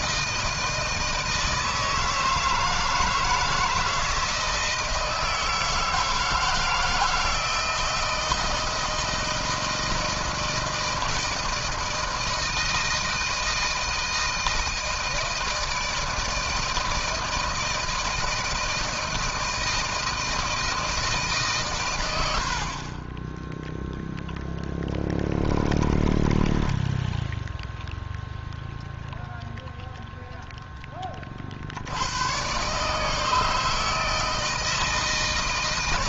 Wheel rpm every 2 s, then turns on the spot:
160, 160, 160, 160, 160, 160, 160, 160, 160, 160, 160, 50, 10, 10, 0, 0, 130, 160.
26-28